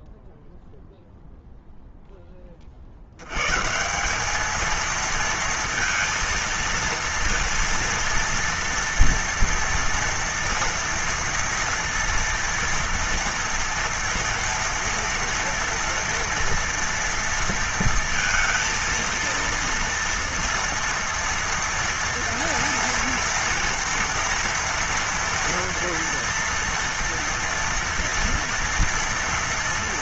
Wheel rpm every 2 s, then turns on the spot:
0, 30, 220, 230, 230, 230, 230, 230, 230, 230, 230, 230, 230, 230, 230.
none